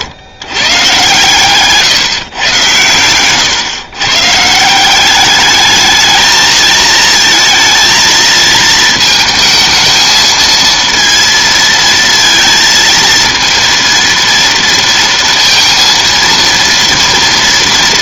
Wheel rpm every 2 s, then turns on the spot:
130, 130, 160, 220, 220, 220, 230, 230, 230.
none